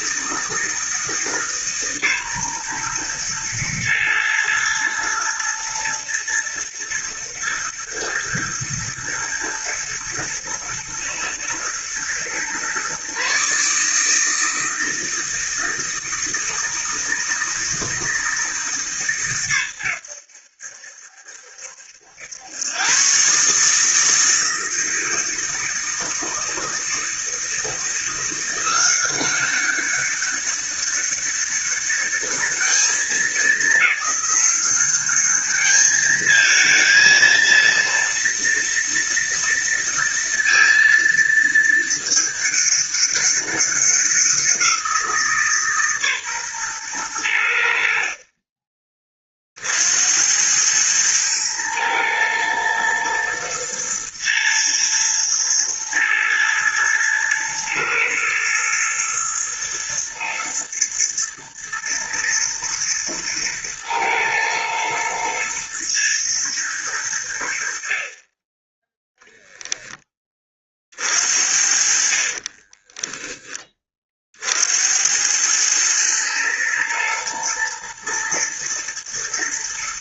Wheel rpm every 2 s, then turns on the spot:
160, 120, 110, 110, 120, 120, 140, 160, 160, 140, 70, 120, 160, 160, 180, 200, 210, 200, 230, 230, 230, 200, 170, 120, 30, 110, 110, 120, 110, 110, 110, 110, 110, 100, 10, 40, 20, 80, 110, 110.
72-74